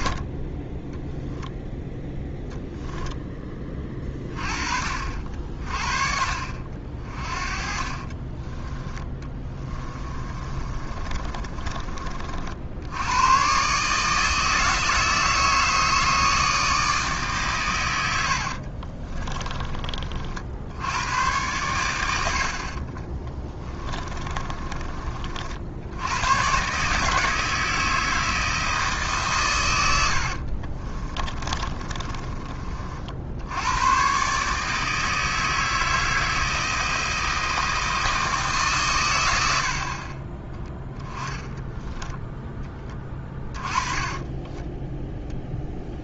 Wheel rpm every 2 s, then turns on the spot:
10, 0, 50, 40, 10, 30, 80, 160, 150, 40, 90, 40, 30, 150, 150, 30, 50, 160, 160, 130, 10, 20, 10.
8-12 18-20 22-24 30-32 42-46